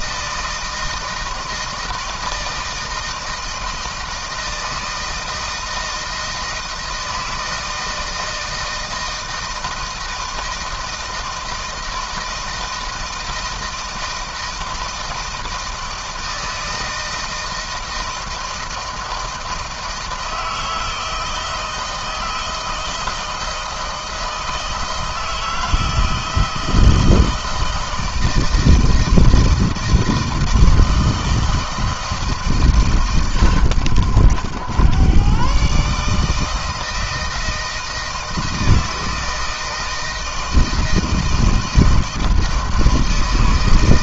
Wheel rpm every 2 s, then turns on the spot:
160, 160, 160, 160, 160, 160, 160, 160, 160, 160, 160, 160, 160, 160, 160, 160, 140, 110, 160, 160, 160, 160.
none